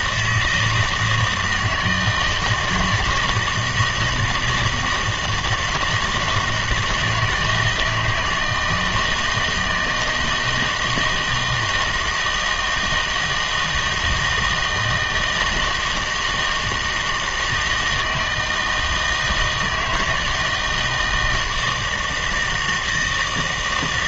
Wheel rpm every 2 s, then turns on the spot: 160, 160, 160, 170, 160, 160, 160, 160, 160, 160, 160, 160.
none